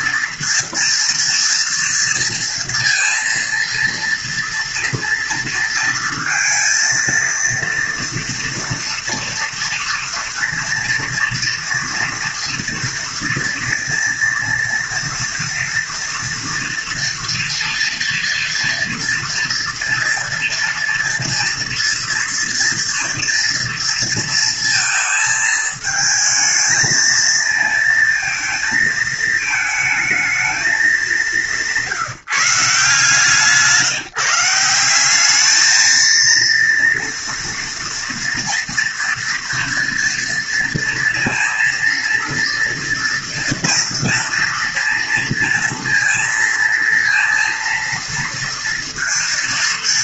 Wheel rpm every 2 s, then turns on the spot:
230, 240, 230, 230, 230, 230, 230, 230, 230, 240, 230, 230, 220, 220, 230, 210, 160, 190, 230, 230, 230, 230, 230, 230, 230.
none